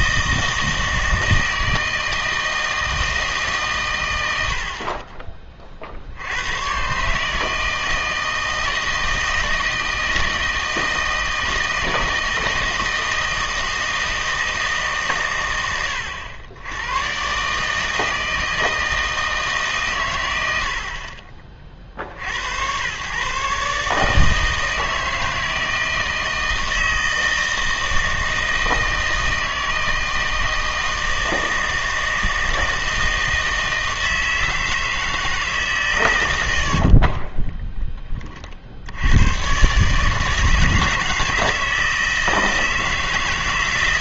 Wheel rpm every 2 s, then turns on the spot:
160, 160, 60, 110, 160, 160, 160, 160, 90, 160, 60, 100, 160, 160, 160, 160, 160, 160, 80, 50, 150, 160.
36-38